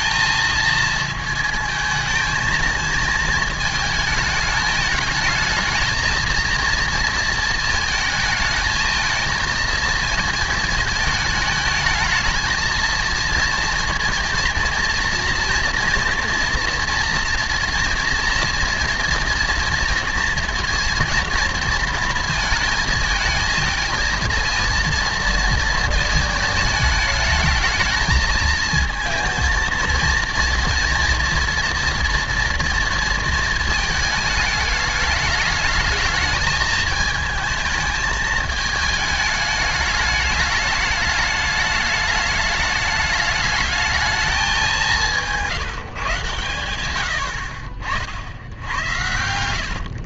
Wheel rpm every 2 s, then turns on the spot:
220, 220, 210, 230, 220, 220, 220, 230, 230, 230, 230, 230, 230, 220, 220, 240, 230, 210, 220, 210, 210, 210, 200, 110, 70.
none